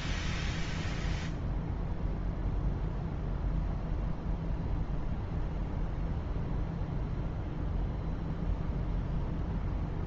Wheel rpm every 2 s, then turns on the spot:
0, 0, 0, 0, 0.
none